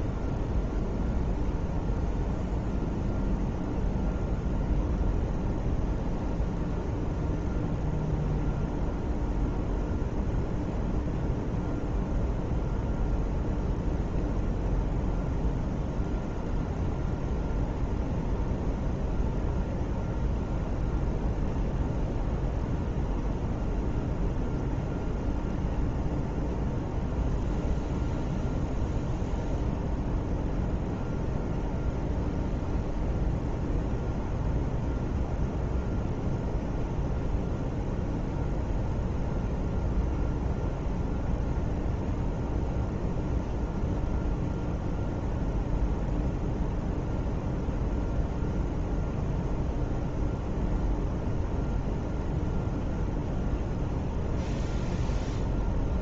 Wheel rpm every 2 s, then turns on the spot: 0, 0, 0, 0, 0, 0, 0, 0, 0, 0, 0, 0, 0, 0, 0, 0, 0, 0, 0, 0, 0, 0, 0, 0, 0, 0, 0, 0.
none